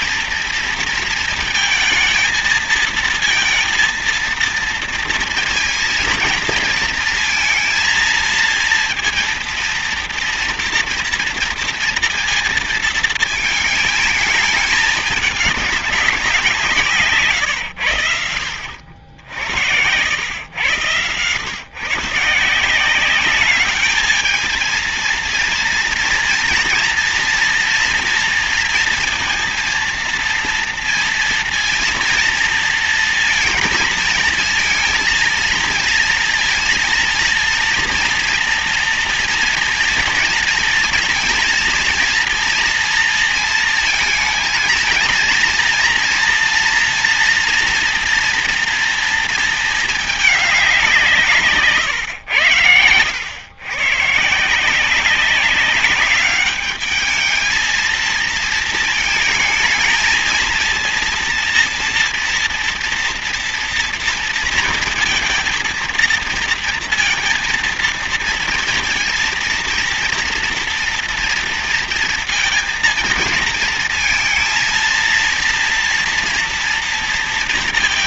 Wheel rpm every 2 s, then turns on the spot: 230, 220, 230, 230, 230, 230, 230, 220, 170, 70, 110, 170, 220, 240, 230, 230, 230, 230, 230, 230, 230, 230, 230, 230, 230, 200, 90, 160, 210, 220, 230, 230, 230, 230, 230, 240, 230, 230, 230.
none